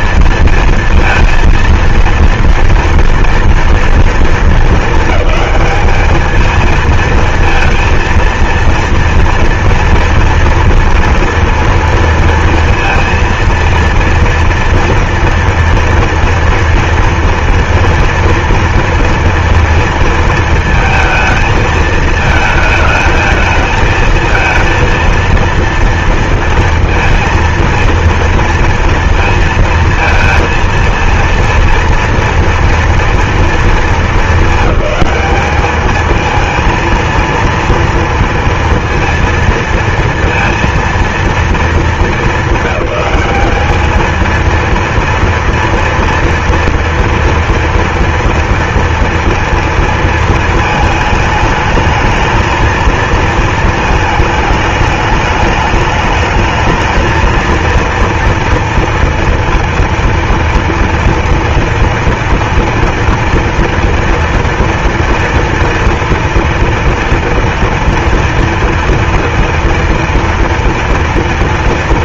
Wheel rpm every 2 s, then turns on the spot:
230, 230, 210, 230, 230, 230, 230, 230, 240, 230, 220, 220, 230, 230, 230, 230, 230, 210, 230, 230, 230, 200, 230, 230, 230, 220, 220, 210, 220, 230, 230, 230, 230, 230, 230, 230.
none